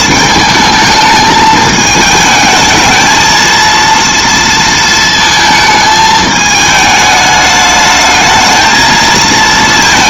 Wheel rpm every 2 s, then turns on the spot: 220, 220, 230, 210, 220.
none